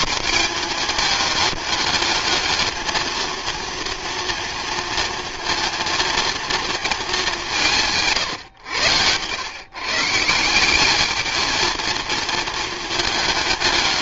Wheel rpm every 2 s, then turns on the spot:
230, 220, 230, 230, 100, 190, 220.
none